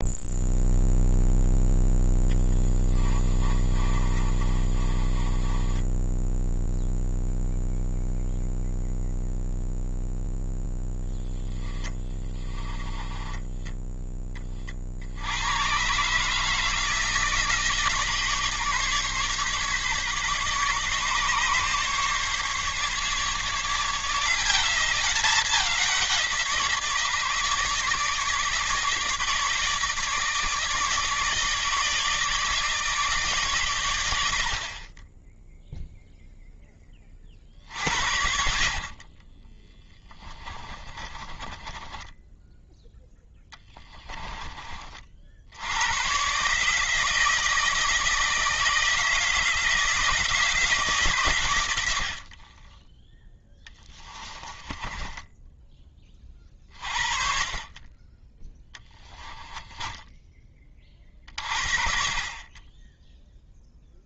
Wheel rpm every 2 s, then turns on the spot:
0, 20, 30, 0, 0, 0, 20, 20, 160, 150, 140, 150, 190, 160, 150, 160, 150, 40, 10, 40, 20, 10, 30, 150, 160, 150, 20, 20, 40, 10, 30, 20.
2-6 12-14 38-44 54-56 58-60